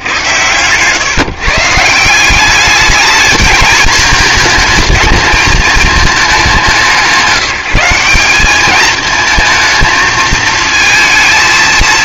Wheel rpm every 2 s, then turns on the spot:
120, 200, 230, 190, 210, 220.
none